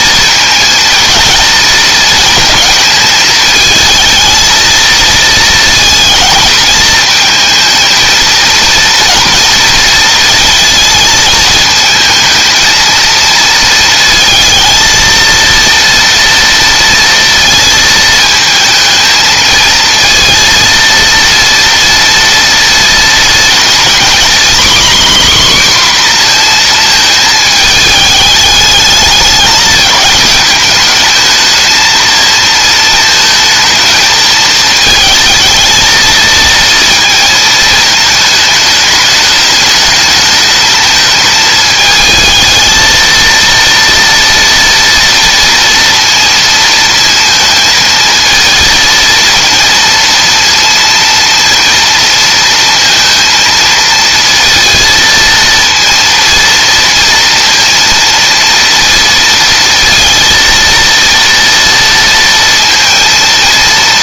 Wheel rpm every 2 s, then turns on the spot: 230, 220, 220, 220, 230, 220, 230, 230, 230, 220, 230, 230, 260, 230, 210, 210, 220, 220, 220, 210, 220, 230, 230, 230, 230, 230, 230, 230, 230, 230, 230, 220.
none